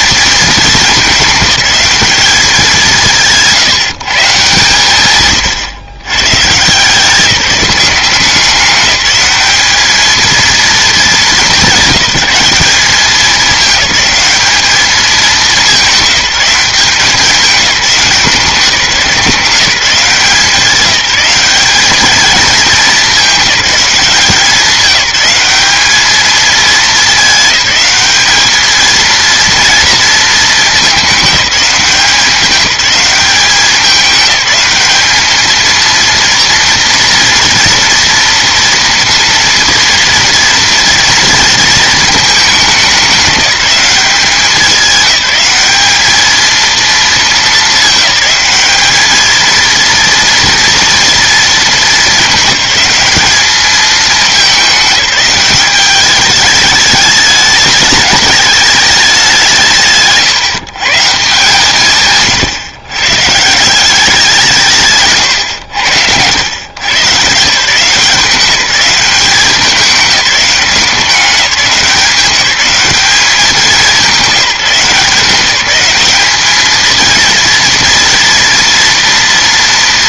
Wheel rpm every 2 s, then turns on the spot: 220, 200, 130, 160, 190, 220, 190, 210, 190, 180, 190, 220, 190, 210, 220, 210, 190, 210, 230, 230, 230, 210, 190, 230, 200, 230, 210, 200, 210, 210, 160, 120, 150, 110, 190, 190, 190, 170, 220, 230.
none